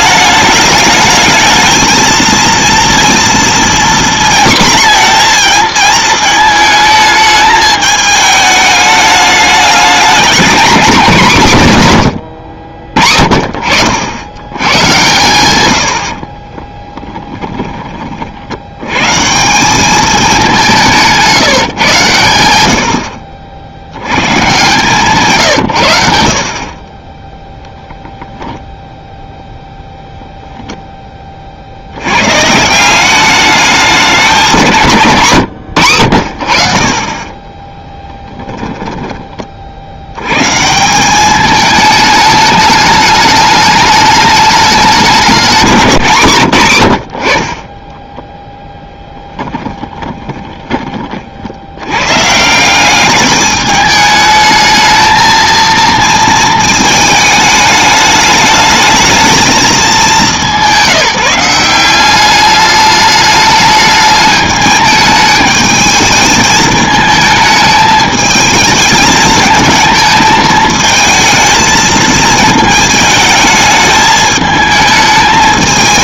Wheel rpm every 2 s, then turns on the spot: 210, 230, 240, 220, 210, 240, 60, 120, 10, 110, 170, 80, 140, 30, 10, 0, 160, 160, 50, 10, 160, 210, 200, 130, 10, 20, 180, 220, 220, 220, 180, 210, 210, 220, 210, 220, 220, 220.
16-18 48-50